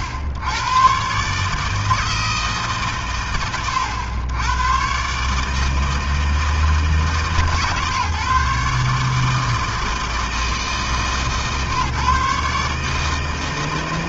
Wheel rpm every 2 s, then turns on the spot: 100, 150, 120, 160, 150, 160, 140.
none